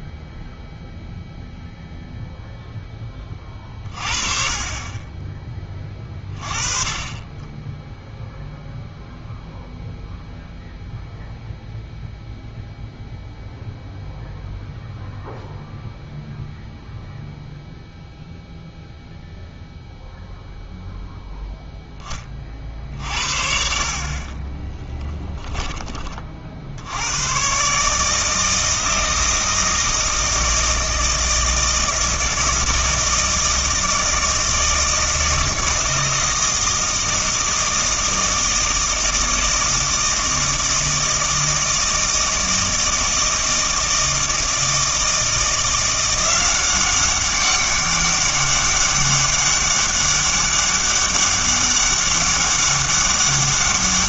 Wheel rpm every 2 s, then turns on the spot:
0, 0, 30, 20, 0, 0, 0, 0, 0, 0, 0, 50, 10, 80, 160, 160, 160, 160, 160, 160, 160, 160, 160, 190, 200, 200, 200.
24-26